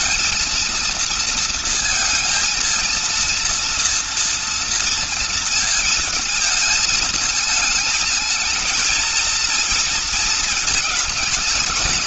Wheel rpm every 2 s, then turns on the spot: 230, 230, 230, 220, 210, 220.
none